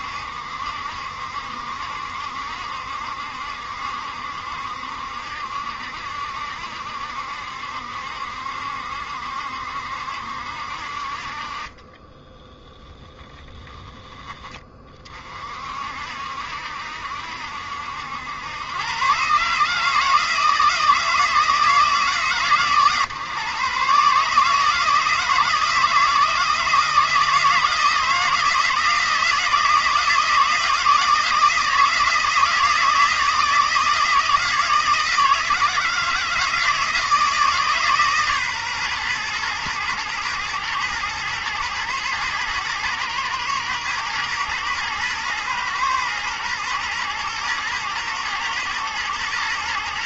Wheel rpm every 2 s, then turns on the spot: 70, 70, 70, 70, 70, 50, 10, 30, 70, 120, 160, 130, 160, 160, 160, 160, 160, 160, 160, 130, 110, 120, 120, 110, 110.
none